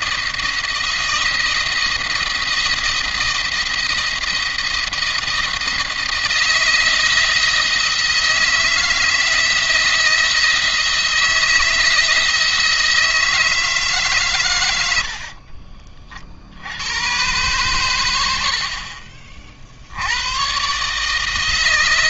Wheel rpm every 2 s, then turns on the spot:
170, 170, 170, 170, 160, 170, 160, 70, 90, 50, 150.
14-16